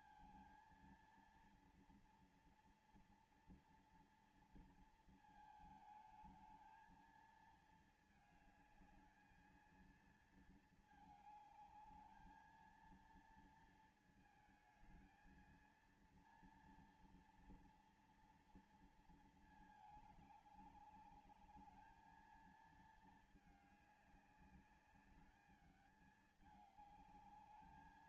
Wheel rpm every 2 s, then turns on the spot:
230, 230, 230, 220, 220, 220, 220, 220, 230, 230, 210, 220, 200, 210.
none